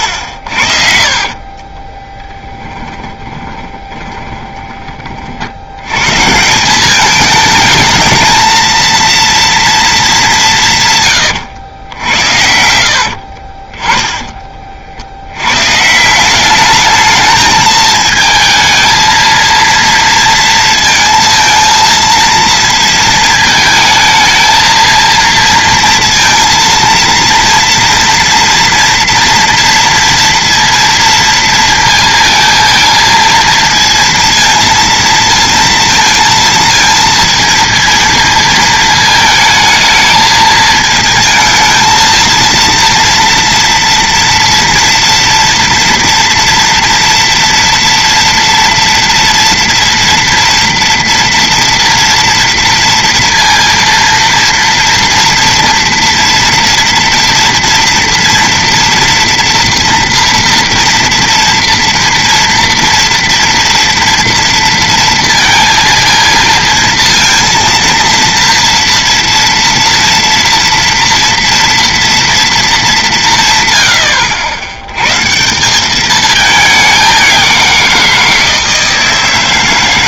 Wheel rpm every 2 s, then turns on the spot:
60, 10, 20, 180, 220, 170, 70, 40, 210, 220, 230, 230, 220, 230, 230, 230, 220, 230, 230, 220, 220, 230, 230, 230, 240, 230, 230, 230, 230, 230, 230, 230, 230, 230, 230, 230, 220, 100, 200, 160.
2-6 12-14